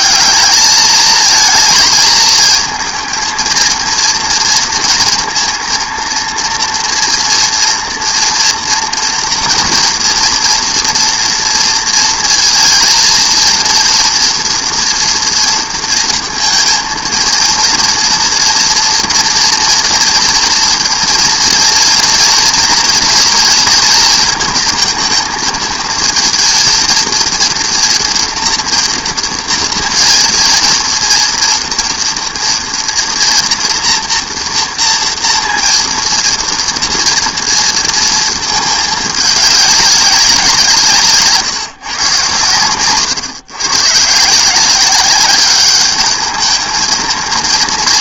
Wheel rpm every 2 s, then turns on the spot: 210, 220, 230, 230, 230, 230, 230, 230, 230, 230, 230, 230, 230, 230, 230, 230, 230, 230, 230, 220, 170, 110, 180, 220.
none